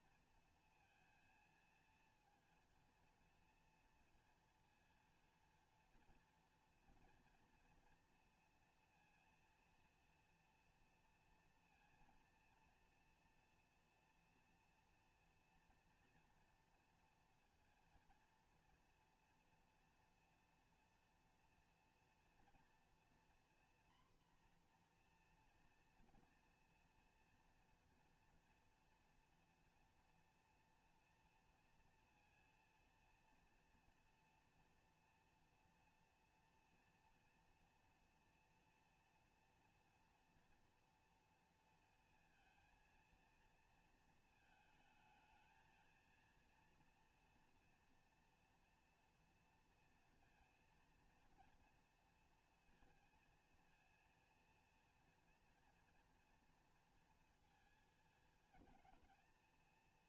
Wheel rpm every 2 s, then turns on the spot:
230, 230, 230, 230, 230, 230, 230, 230, 230, 230, 240, 230, 250, 230, 230, 230, 230, 230, 230, 230, 230, 230, 230, 230, 230, 230, 230, 230, 230, 220.
none